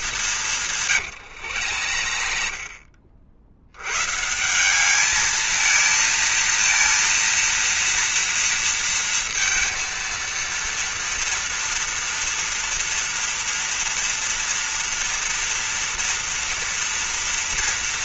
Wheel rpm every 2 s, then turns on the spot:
180, 50, 170, 230, 230, 230, 230, 230, 230.
2-4